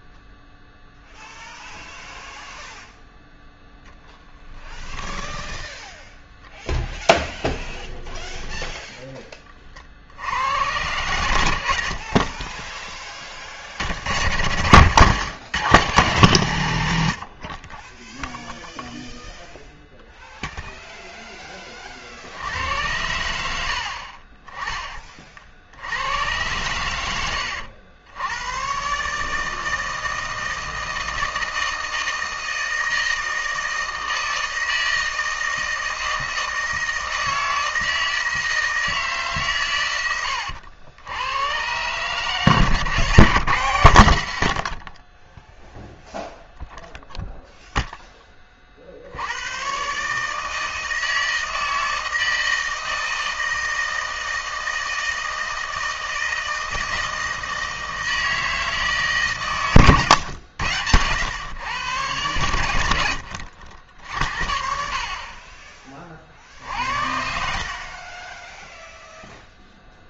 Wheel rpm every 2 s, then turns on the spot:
0, 0, 10, 10, 10, 90, 20, 120, 120, 0, 0, 80, 30, 100, 110, 160, 160, 160, 160, 160, 90, 140, 80, 0, 50, 160, 160, 160, 160, 160, 100, 100, 60, 60, 10.
8-10